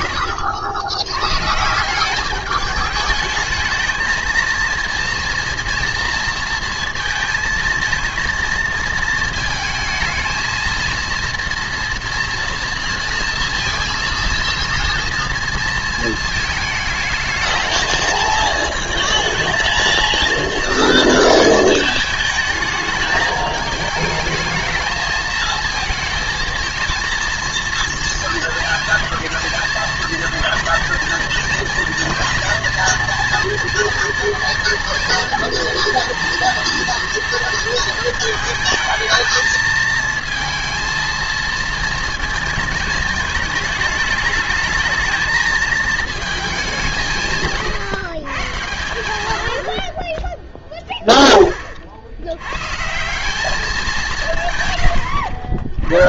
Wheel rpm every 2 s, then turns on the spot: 100, 210, 230, 230, 230, 230, 230, 230, 220, 230, 230, 220, 220, 230, 230, 230, 230, 230, 230, 220, 220, 220, 210, 200, 120, 10, 120, 140.
none